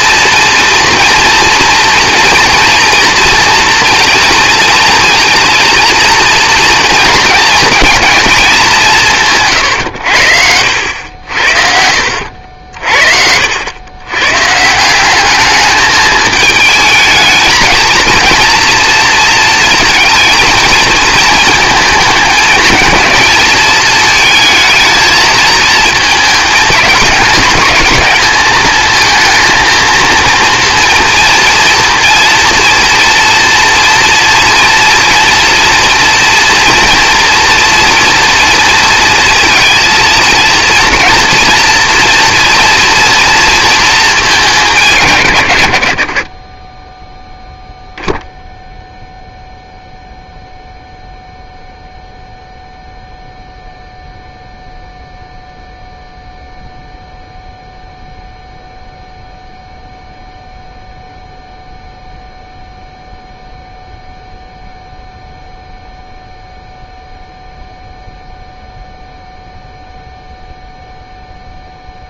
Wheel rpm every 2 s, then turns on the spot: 230, 240, 230, 230, 200, 80, 70, 150, 220, 230, 230, 220, 220, 210, 220, 230, 230, 230, 240, 230, 230, 230, 200, 20, 0, 0, 0, 0, 0, 0, 0, 0, 0, 0, 0, 0.
12-14